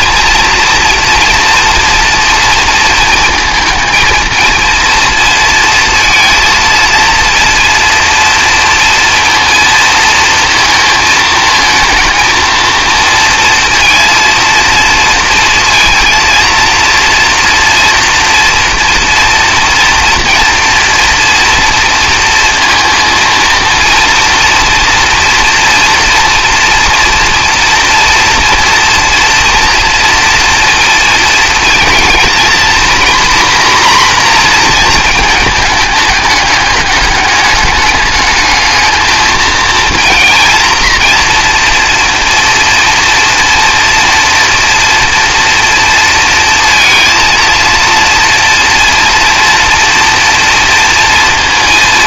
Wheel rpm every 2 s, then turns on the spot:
230, 230, 230, 230, 230, 220, 230, 230, 230, 230, 240, 230, 240, 230, 230, 230, 240, 230, 210, 220, 230, 230, 230, 230, 230, 230.
none